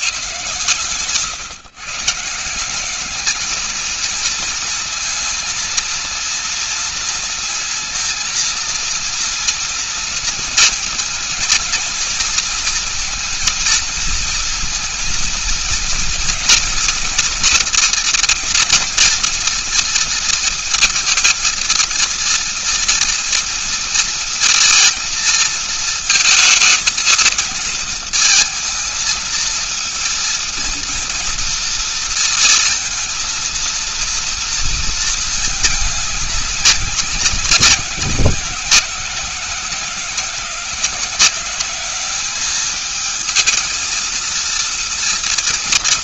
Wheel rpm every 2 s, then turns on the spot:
130, 170, 230, 230, 230, 230, 220, 230, 230, 230, 230, 230, 240, 230, 220, 220, 230, 230, 210, 180, 180, 200, 230.
none